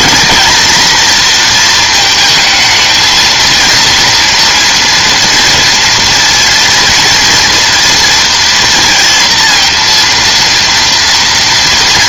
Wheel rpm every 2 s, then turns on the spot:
240, 220, 230, 230, 230, 230.
none